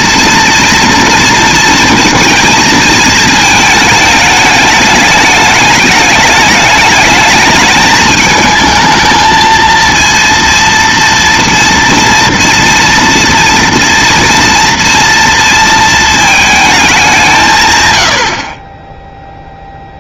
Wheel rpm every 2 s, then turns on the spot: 230, 220, 210, 210, 220, 230, 230, 230, 210, 20.
none